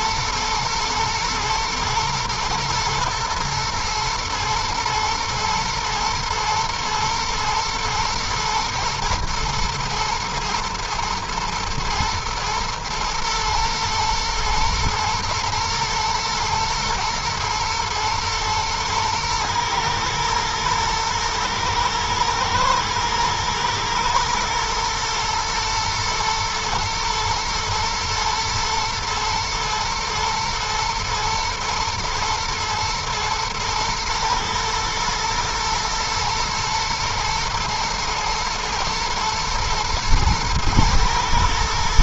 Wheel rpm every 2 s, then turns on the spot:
110, 110, 120, 120, 110, 120, 120, 120, 110, 110, 120, 120, 120, 110, 110, 110, 120, 110, 120, 120, 110.
none